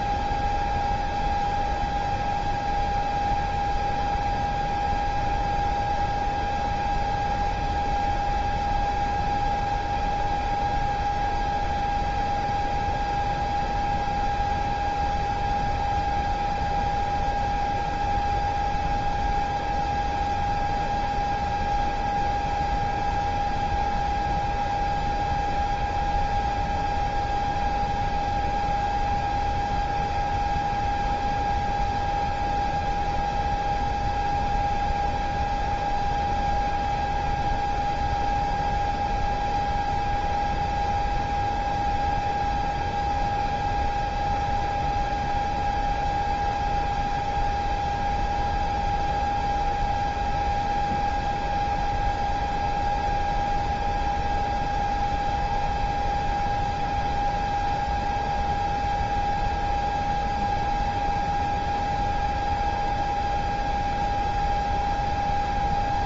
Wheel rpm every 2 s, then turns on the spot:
0, 0, 0, 0, 0, 0, 0, 0, 0, 0, 0, 0, 0, 0, 0, 0, 0, 0, 0, 0, 0, 0, 0, 0, 0, 0, 0, 0, 0, 0, 0, 0, 0.
none